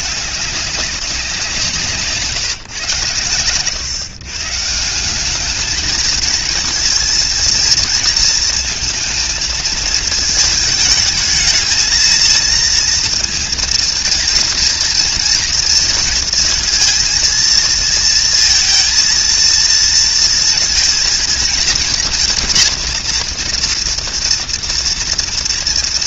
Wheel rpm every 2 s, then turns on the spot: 200, 140, 150, 220, 230, 220, 230, 230, 230, 230, 230, 230, 240.
none